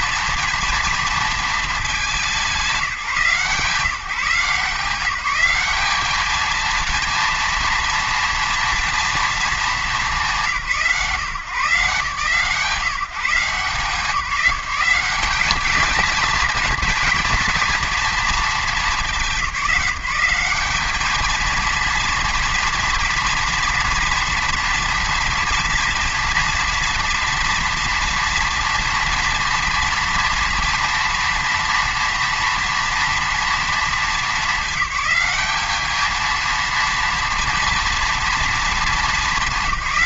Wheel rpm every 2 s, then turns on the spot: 230, 180, 170, 230, 230, 160, 160, 180, 230, 220, 200, 230, 230, 230, 230, 230, 230, 210, 230, 220.
none